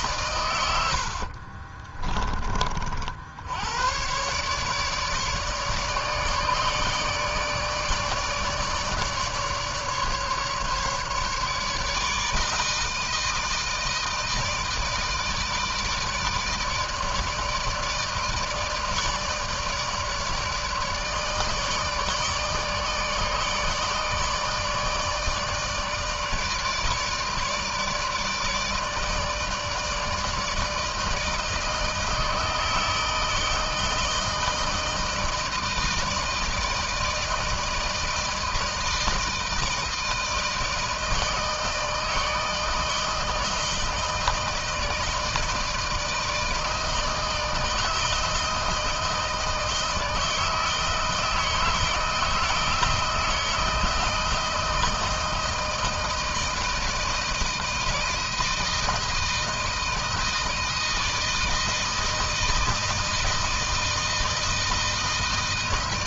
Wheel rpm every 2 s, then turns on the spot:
90, 50, 140, 150, 150, 150, 160, 160, 160, 150, 150, 160, 160, 160, 150, 160, 160, 160, 160, 160, 160, 160, 160, 160, 160, 160, 160, 160, 160, 160, 160, 160, 160.
0-2